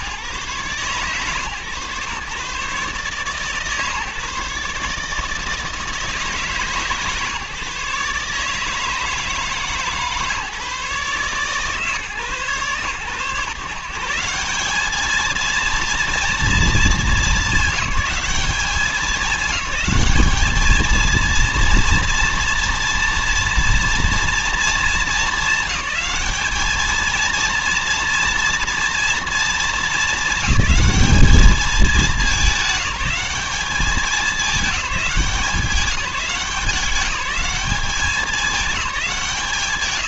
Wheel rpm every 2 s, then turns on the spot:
120, 140, 150, 150, 160, 140, 120, 200, 210, 200, 220, 230, 220, 220, 230, 210, 210, 200, 190, 200.
none